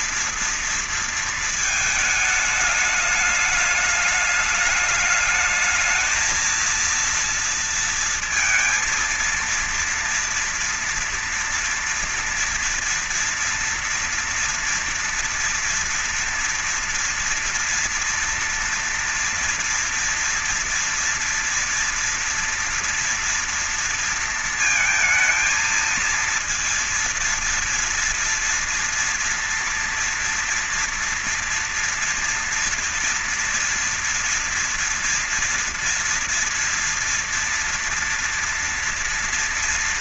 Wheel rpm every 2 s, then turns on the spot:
230, 210, 210, 220, 230, 230, 230, 230, 230, 230, 230, 230, 230, 230, 230, 230, 230, 230, 230, 230.
none